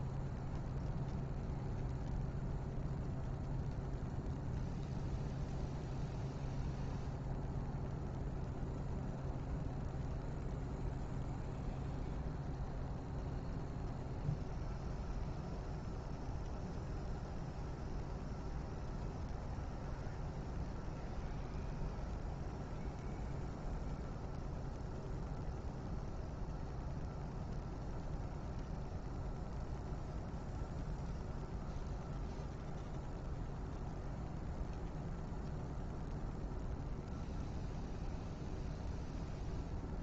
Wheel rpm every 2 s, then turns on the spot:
0, 0, 0, 0, 0, 0, 0, 0, 0, 0, 0, 0, 0, 0, 0, 0, 0, 0, 0, 0.
none